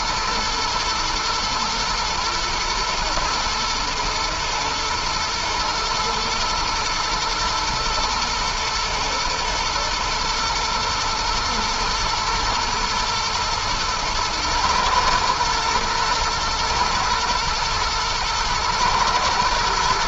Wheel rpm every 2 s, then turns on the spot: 110, 110, 110, 110, 120, 120, 120, 110, 110, 110.
none